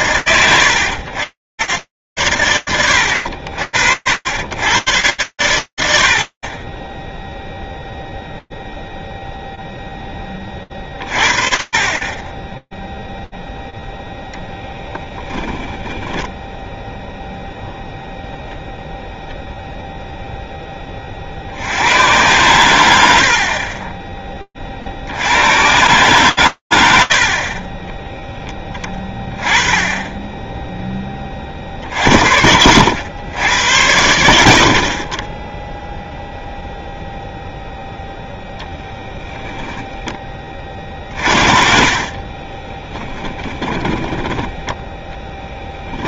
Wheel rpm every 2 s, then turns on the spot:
100, 80, 90, 0, 20, 20, 0, 0, 0, 10, 100, 40, 110, 10, 10, 70, 60, 0, 0, 40, 20, 10, 20.
40-46